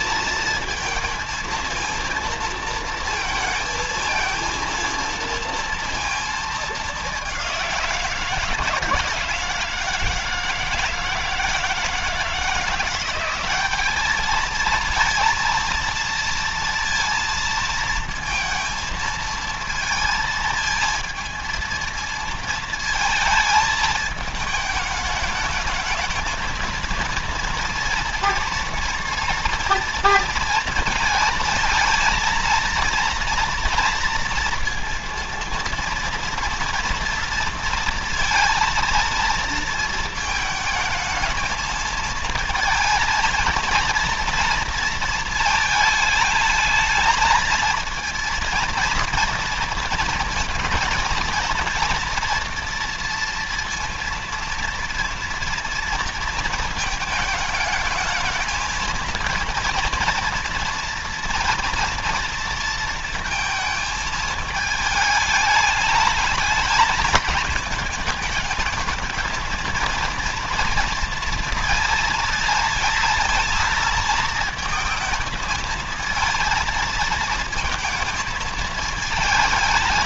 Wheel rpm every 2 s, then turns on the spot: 230, 230, 230, 220, 160, 160, 170, 220, 230, 230, 230, 220, 220, 220, 230, 230, 230, 230, 230, 230, 220, 220, 230, 220, 230, 230, 230, 230, 230, 220, 240, 230, 220, 220, 220, 230, 230, 220, 230, 220.
none